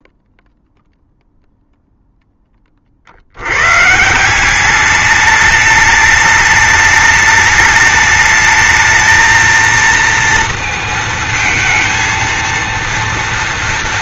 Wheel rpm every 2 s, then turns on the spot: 0, 20, 200, 210, 220, 230, 230.
none